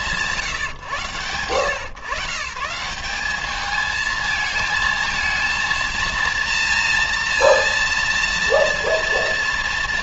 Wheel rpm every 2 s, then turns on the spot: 130, 220, 230, 230, 230.
none